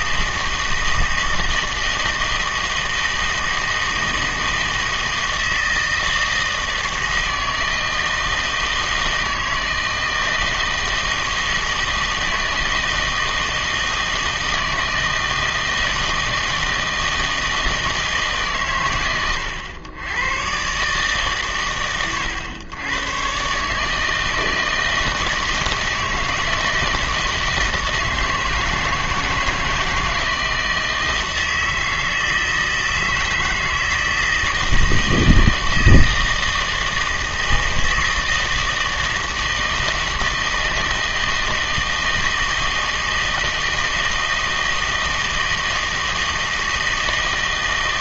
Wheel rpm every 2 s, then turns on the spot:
160, 160, 160, 160, 160, 160, 160, 160, 160, 120, 140, 110, 160, 160, 160, 160, 160, 160, 160, 160, 160, 160, 160, 160.
none